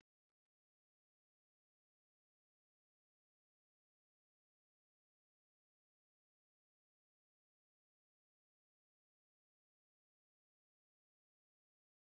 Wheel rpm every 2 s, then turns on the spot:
0, 0, 0, 0, 0, 0.
none